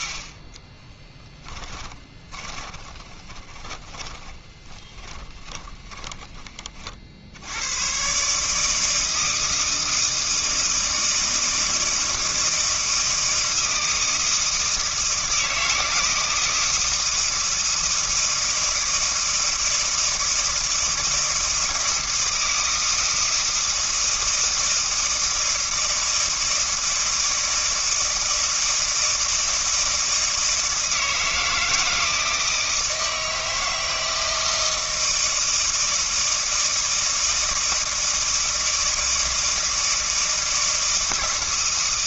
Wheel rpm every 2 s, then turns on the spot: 10, 30, 20, 30, 160, 160, 160, 160, 160, 160, 160, 160, 160, 160, 160, 160, 160, 160, 160, 160, 160.
0-6